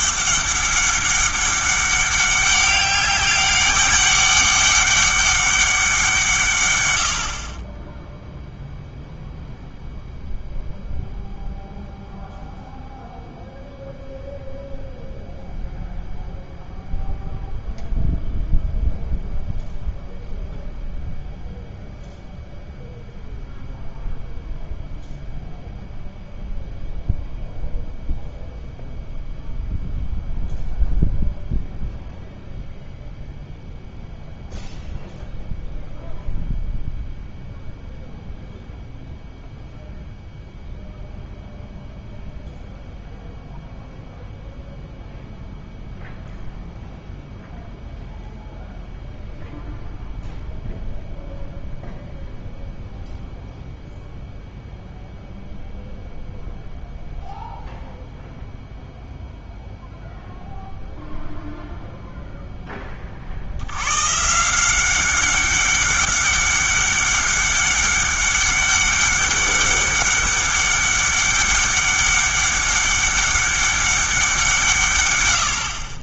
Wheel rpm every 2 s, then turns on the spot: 200, 200, 200, 120, 0, 0, 0, 0, 0, 0, 0, 0, 0, 0, 0, 0, 0, 0, 0, 0, 0, 0, 0, 0, 0, 0, 0, 0, 0, 0, 0, 10, 180, 200, 200, 200, 200, 170.
none